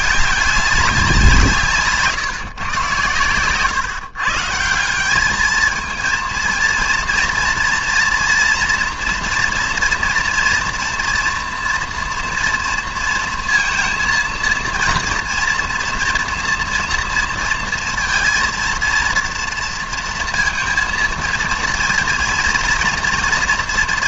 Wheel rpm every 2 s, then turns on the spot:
200, 120, 170, 230, 240, 230, 230, 230, 230, 230, 230, 230.
none